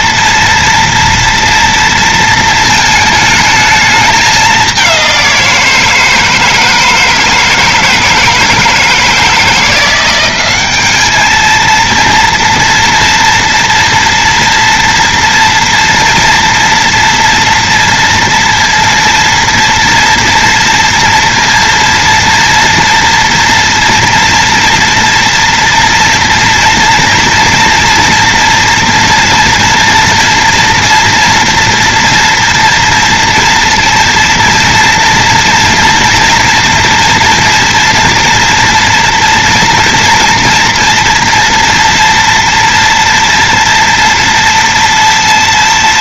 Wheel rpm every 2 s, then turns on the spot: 230, 220, 200, 160, 160, 200, 230, 230, 230, 230, 240, 240, 230, 230, 230, 240, 230, 230, 230, 240, 230, 230, 230.
none